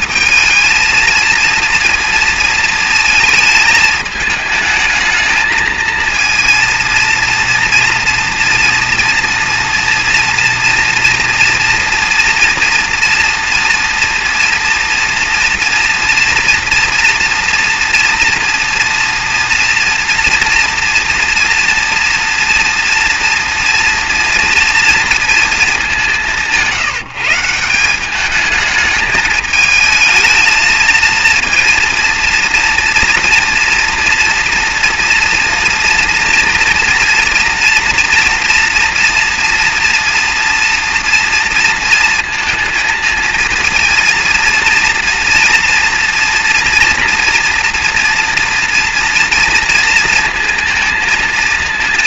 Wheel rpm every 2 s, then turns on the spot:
220, 230, 220, 230, 230, 230, 230, 240, 230, 230, 230, 230, 230, 180, 210, 220, 230, 230, 230, 230, 240, 230, 230, 230, 230, 230.
none